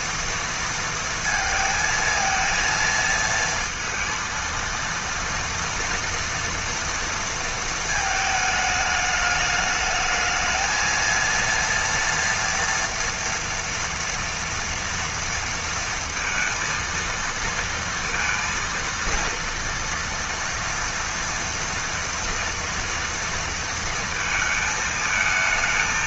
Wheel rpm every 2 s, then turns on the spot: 230, 230, 230, 230, 210, 220, 230, 240, 230, 230, 230, 230, 220.
none